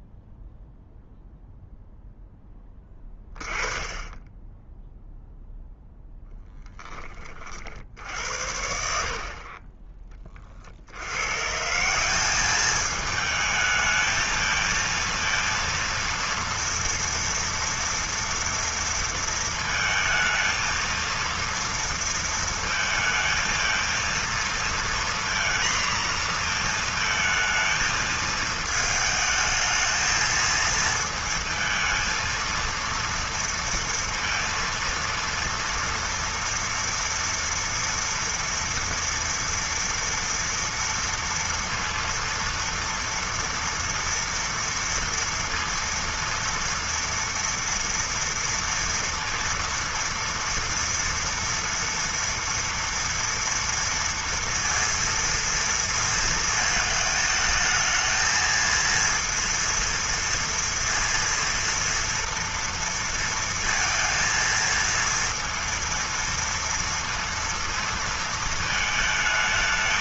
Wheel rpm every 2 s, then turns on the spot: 0, 10, 10, 30, 60, 90, 210, 230, 230, 230, 230, 220, 230, 230, 220, 220, 230, 230, 230, 230, 230, 230, 230, 230, 230, 230, 230, 230, 220, 230, 230, 230, 230, 230, 220.
none